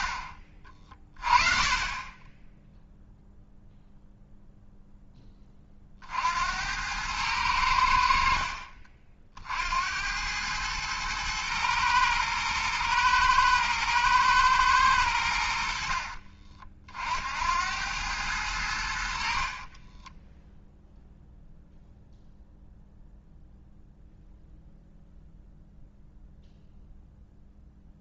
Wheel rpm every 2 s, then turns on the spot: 40, 0, 0, 90, 40, 110, 110, 110, 50, 70, 0, 0, 0, 0.
none